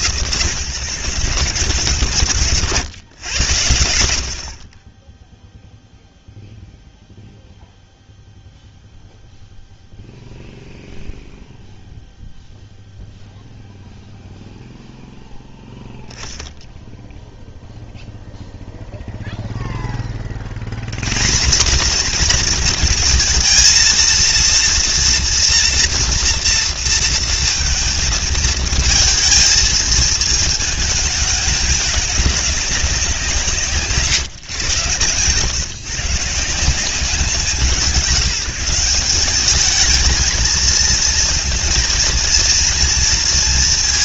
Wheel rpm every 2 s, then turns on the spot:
140, 140, 40, 0, 0, 0, 0, 0, 0, 0, 110, 230, 230, 230, 230, 220, 190, 120, 170, 200, 220, 230.
4-6